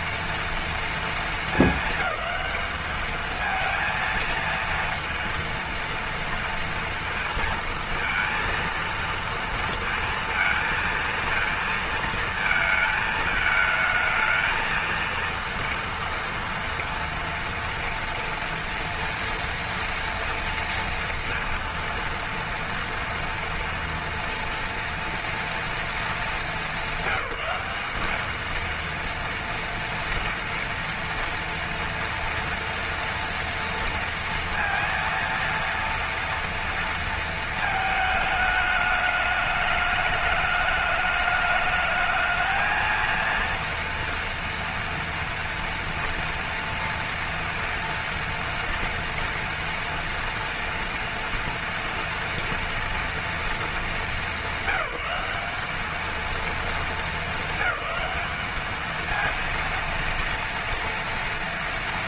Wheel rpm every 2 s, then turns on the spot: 230, 220, 230, 230, 230, 230, 230, 220, 240, 230, 230, 230, 230, 220, 210, 230, 230, 230, 230, 220, 210, 220, 230, 230, 230, 230, 230, 200, 230, 210, 230.
none